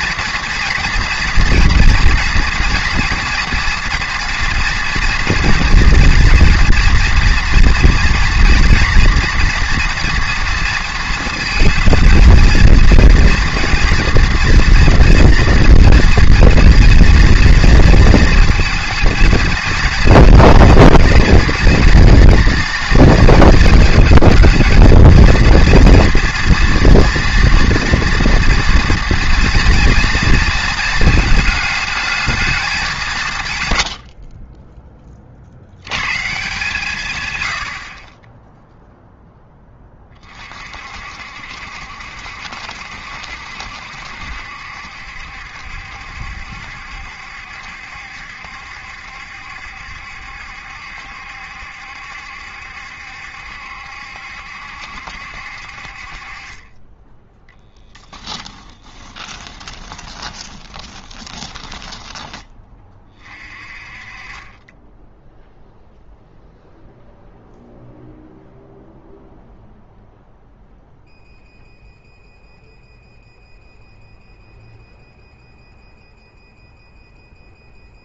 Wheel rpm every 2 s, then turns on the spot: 230, 230, 230, 230, 240, 230, 230, 240, 240, 230, 240, 220, 220, 230, 230, 230, 200, 20, 150, 0, 50, 70, 70, 70, 70, 70, 70, 70, 20, 20, 30, 30, 10, 0, 0, 0, 0, 0, 0.
58-62